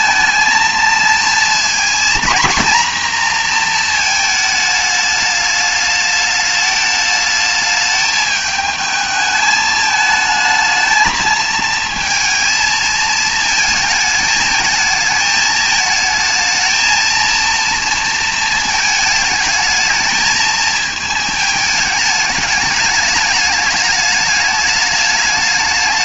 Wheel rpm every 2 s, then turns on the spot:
220, 230, 220, 210, 210, 220, 220, 220, 220, 230, 220, 210, 210.
none